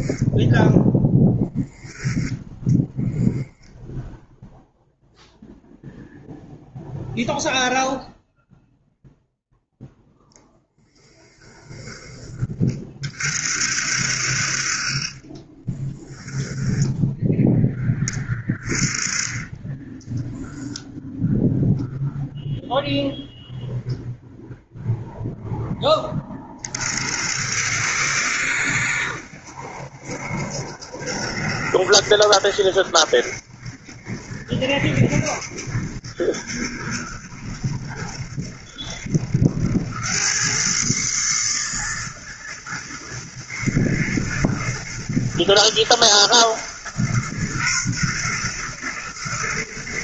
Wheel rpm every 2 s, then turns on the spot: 0, 0, 0, 0, 0, 10, 30, 50, 10, 20, 0, 0, 0, 30, 70, 70, 70, 70, 70, 70, 100, 120, 110, 120, 120.
10-12 16-18